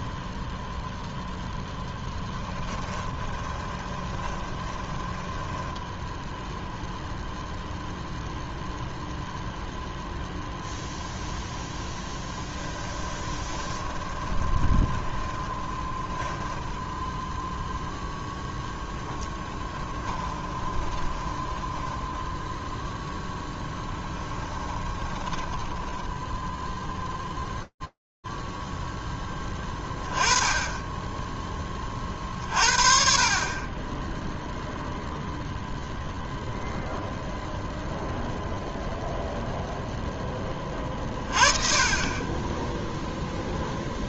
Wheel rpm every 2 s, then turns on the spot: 0, 10, 10, 0, 0, 0, 10, 20, 30, 0, 20, 0, 10, 0, 10, 0, 30, 0, 0, 0, 20, 0.
2-6 12-18 20-22 24-26